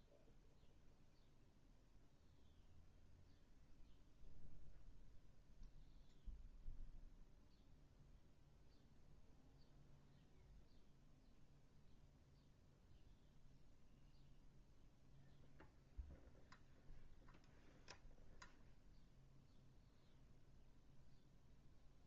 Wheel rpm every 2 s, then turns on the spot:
0, 0, 0, 0, 0, 0, 0, 0, 0, 0, 0.
none